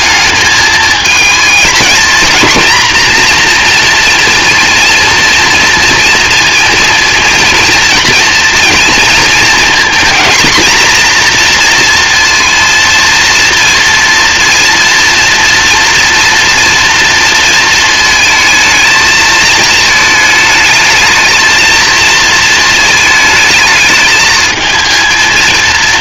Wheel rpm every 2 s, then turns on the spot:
220, 240, 230, 230, 230, 230, 230, 230, 230, 220, 210, 220, 220.
none